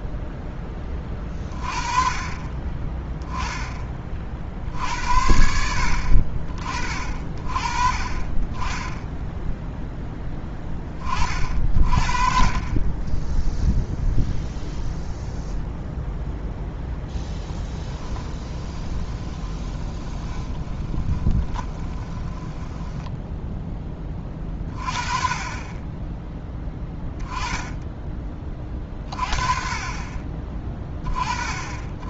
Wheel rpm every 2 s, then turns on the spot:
20, 20, 50, 40, 20, 20, 30, 0, 0, 20, 20, 10, 30, 10, 30, 20.
18-24